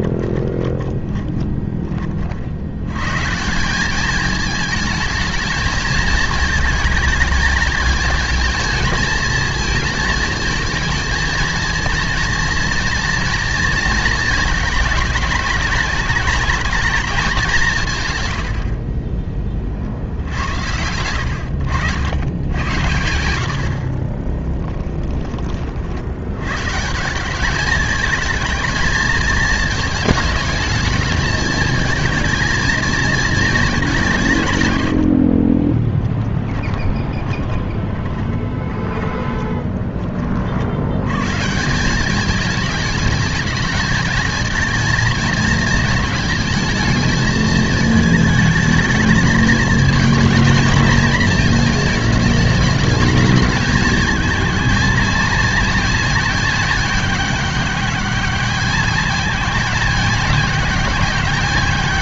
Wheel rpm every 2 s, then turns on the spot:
20, 80, 220, 220, 220, 220, 230, 220, 220, 80, 80, 100, 10, 120, 220, 220, 230, 140, 20, 30, 60, 210, 220, 220, 220, 220, 220, 230, 220, 210, 210.
0-2 18-20 24-26 36-40